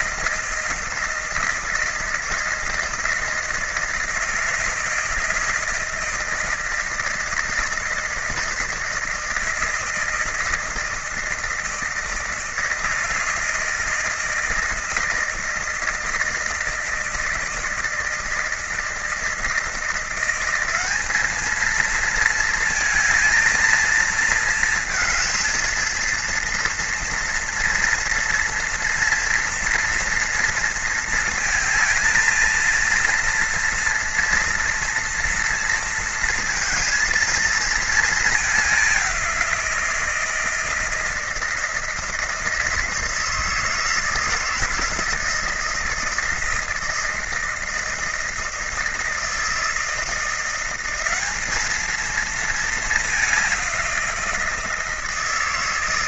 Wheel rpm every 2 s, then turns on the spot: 160, 160, 160, 160, 160, 160, 160, 160, 160, 160, 190, 230, 220, 230, 230, 230, 230, 240, 230, 190, 160, 160, 160, 160, 160, 180, 210, 170.
none